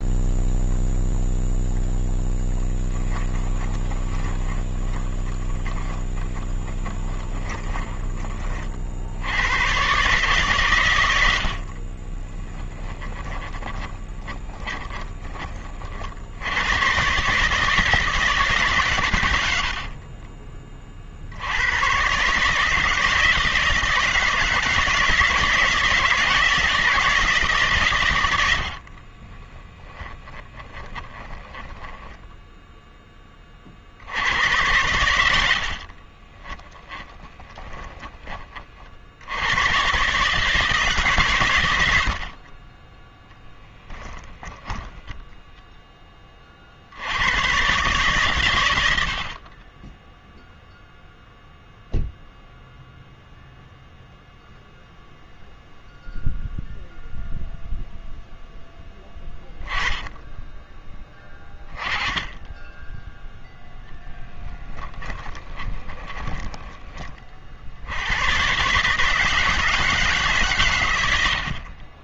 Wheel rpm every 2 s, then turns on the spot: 0, 10, 30, 20, 50, 120, 20, 20, 110, 130, 40, 150, 160, 170, 60, 20, 10, 100, 20, 50, 150, 20, 10, 50, 90, 0, 0, 0, 0, 10, 10, 10, 10, 10, 140, 110.
2-8 12-16 28-32 36-38 44-46 64-66